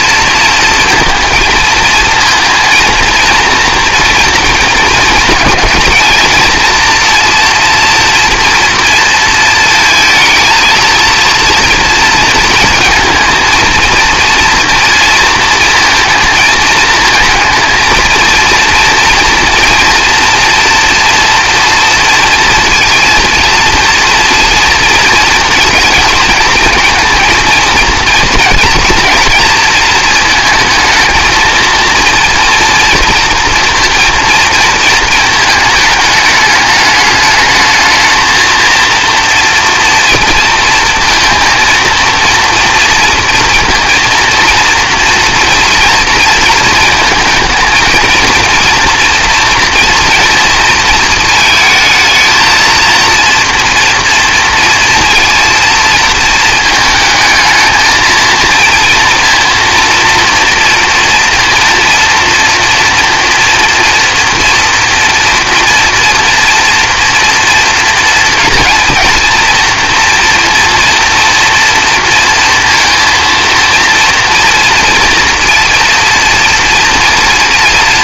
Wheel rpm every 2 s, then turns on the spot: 230, 230, 230, 230, 230, 220, 230, 230, 220, 230, 230, 230, 230, 220, 230, 220, 240, 220, 210, 230, 230, 230, 230, 230, 230, 230, 220, 230, 220, 230, 230, 230, 230, 230, 230, 230, 230, 230, 230.
none